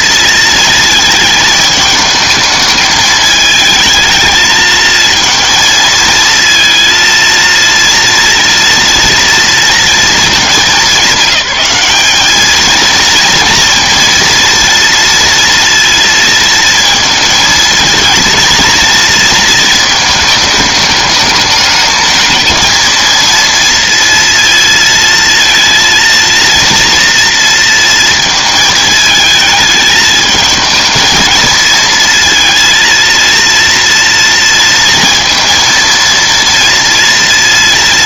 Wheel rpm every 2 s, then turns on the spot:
220, 220, 230, 230, 230, 200, 230, 230, 220, 230, 210, 230, 220, 230, 220, 220, 230, 230, 230.
none